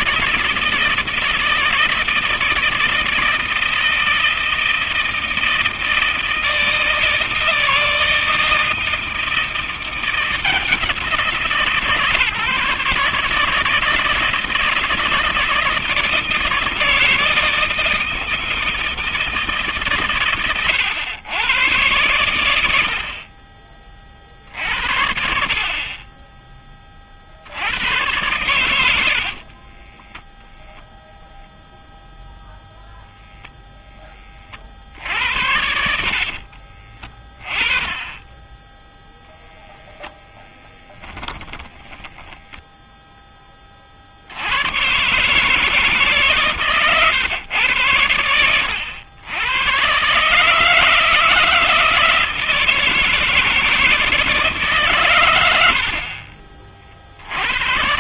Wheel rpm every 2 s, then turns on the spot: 160, 160, 160, 160, 160, 160, 150, 160, 160, 160, 100, 40, 80, 30, 100, 0, 0, 30, 40, 20, 10, 10, 80, 140, 90, 140, 160, 150, 50.
28-30 36-38